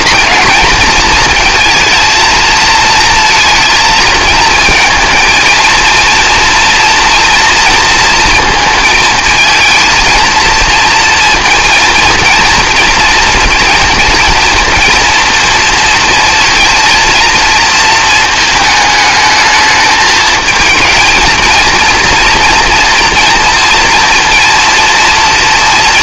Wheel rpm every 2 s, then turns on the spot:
230, 230, 230, 230, 230, 230, 230, 230, 220, 220, 230, 230, 230.
none